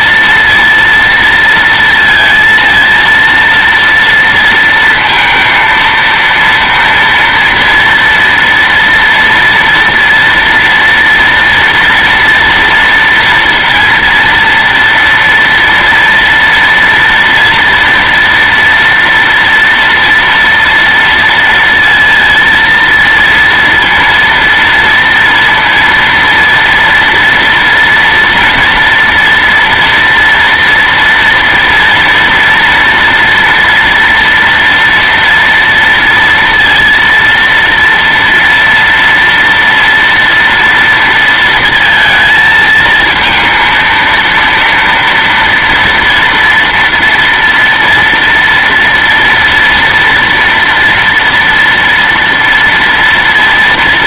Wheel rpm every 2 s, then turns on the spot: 230, 230, 230, 230, 230, 230, 230, 230, 230, 240, 230, 230, 230, 230, 230, 230, 230, 230, 230, 230, 230, 220, 230, 230, 230, 240, 230.
none